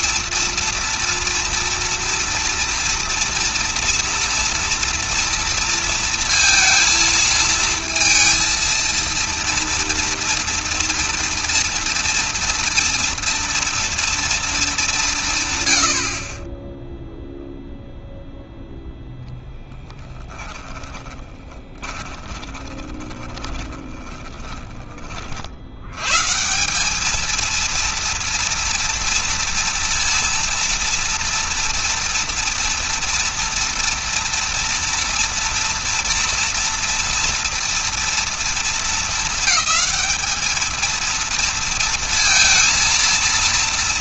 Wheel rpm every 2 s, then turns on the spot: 230, 230, 230, 230, 230, 230, 230, 200, 20, 0, 10, 20, 20, 170, 230, 230, 230, 240, 230, 220, 220, 230.
20-24